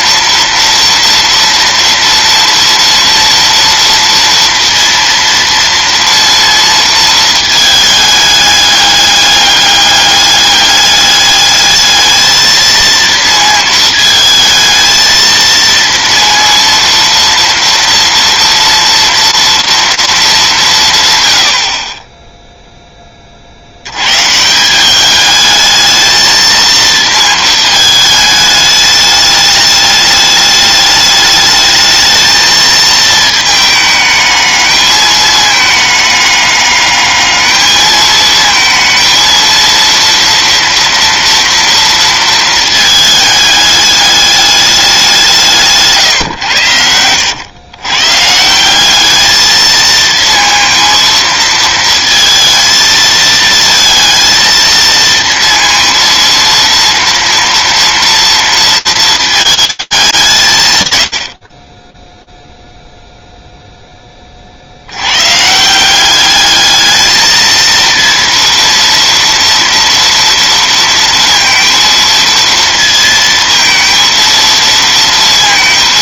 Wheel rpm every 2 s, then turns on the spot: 230, 230, 230, 230, 210, 200, 220, 220, 230, 230, 180, 0, 170, 230, 210, 210, 220, 210, 210, 220, 230, 220, 200, 100, 190, 230, 230, 230, 230, 230, 120, 0, 100, 220, 230, 230, 230, 230.
none